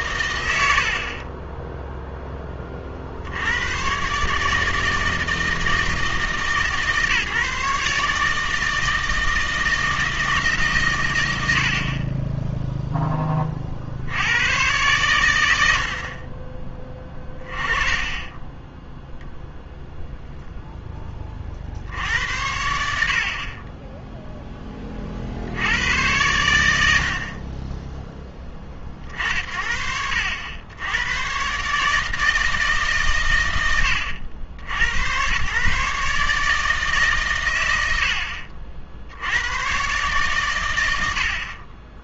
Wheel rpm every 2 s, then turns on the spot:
70, 20, 150, 150, 160, 140, 0, 110, 20, 10, 0, 70, 10, 90, 30, 90, 160, 80, 150, 50, 110.
0-2 18-20